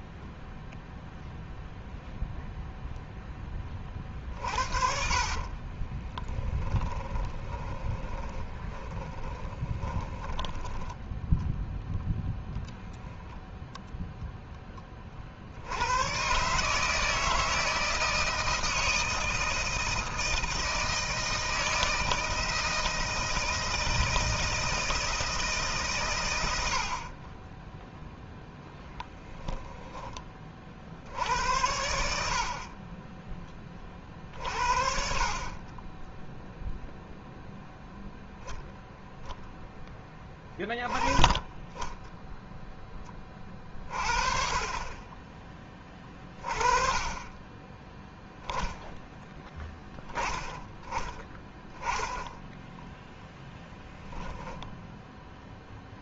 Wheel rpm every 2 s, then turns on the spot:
0, 0, 50, 10, 30, 10, 0, 20, 150, 160, 160, 160, 160, 60, 10, 50, 40, 50, 0, 0, 20, 10, 30, 20, 0, 10, 10, 0.
4-10 28-30 52-54